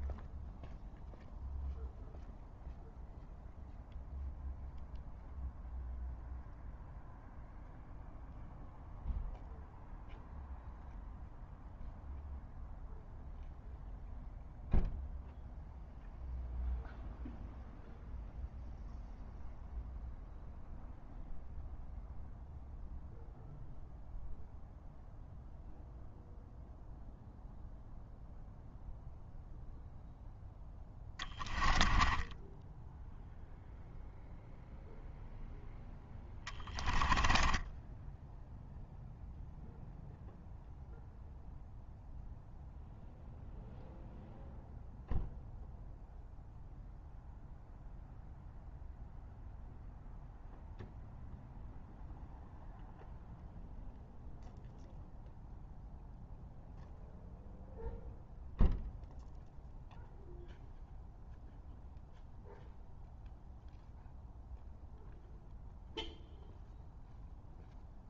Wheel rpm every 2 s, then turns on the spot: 0, 0, 0, 0, 0, 0, 0, 0, 0, 0, 0, 0, 0, 0, 0, 10, 10, 0, 20, 0, 0, 0, 0, 0, 0, 0, 0, 0, 0, 0, 0, 0, 0, 0.
30-34 36-38